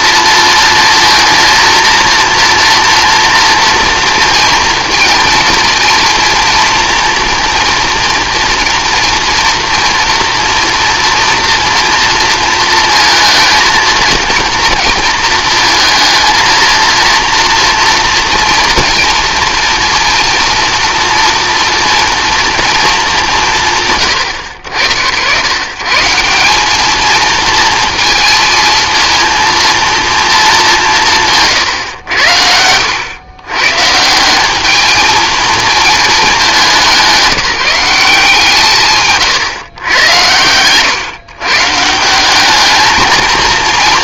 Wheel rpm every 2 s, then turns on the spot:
230, 230, 230, 230, 230, 230, 220, 230, 230, 230, 240, 220, 70, 210, 230, 200, 90, 210, 190, 130, 120, 220.
none